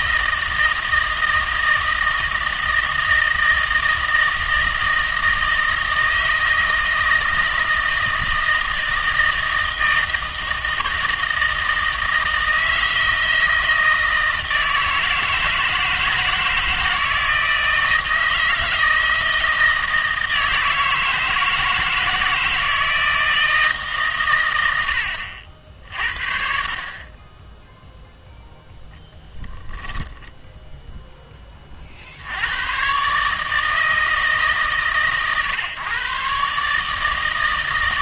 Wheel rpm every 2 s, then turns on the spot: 160, 160, 160, 160, 160, 160, 160, 160, 160, 160, 160, 170, 100, 50, 0, 0, 110, 140, 150.
none